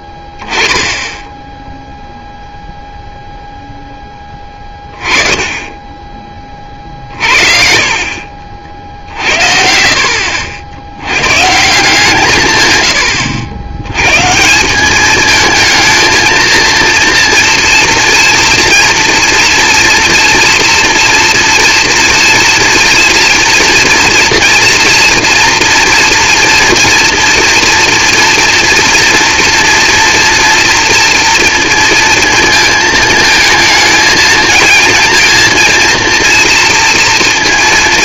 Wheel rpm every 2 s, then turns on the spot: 10, 0, 10, 40, 60, 120, 90, 210, 230, 240, 230, 230, 230, 230, 230, 230, 220, 230, 230.
none